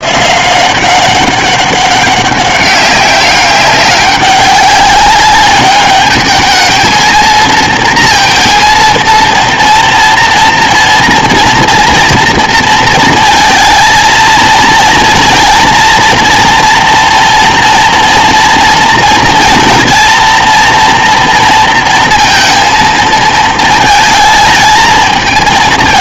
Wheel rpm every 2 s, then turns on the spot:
180, 200, 200, 220, 230, 230, 230, 230, 230, 230, 240, 230, 220.
none